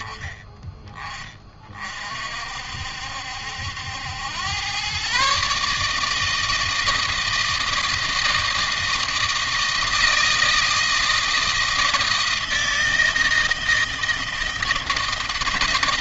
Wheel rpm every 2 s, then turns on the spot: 20, 60, 120, 160, 160, 160, 160, 160.
none